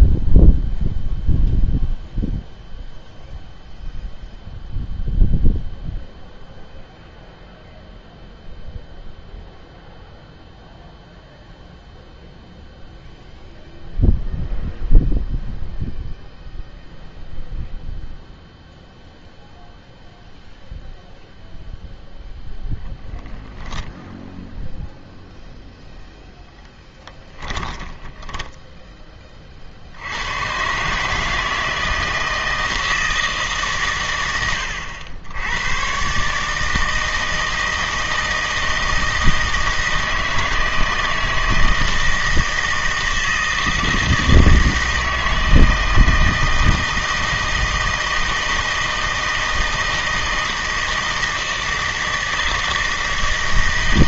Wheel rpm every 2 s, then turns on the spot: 0, 0, 0, 0, 0, 0, 0, 0, 0, 0, 0, 0, 0, 10, 20, 130, 160, 100, 160, 160, 160, 160, 160, 160, 160, 160, 160.
26-30